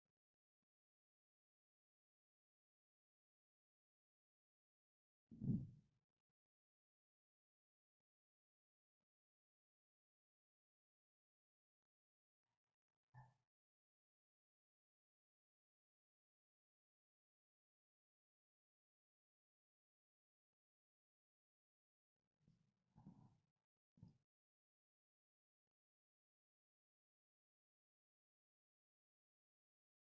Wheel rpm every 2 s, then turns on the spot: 0, 0, 0, 0, 0, 0, 0, 0, 0, 0, 0, 0, 0, 0, 0.
none